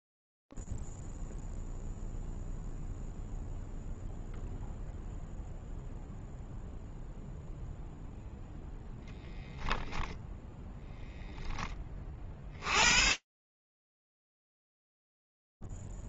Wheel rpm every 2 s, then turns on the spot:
0, 0, 0, 0, 0, 10, 30, 0.
none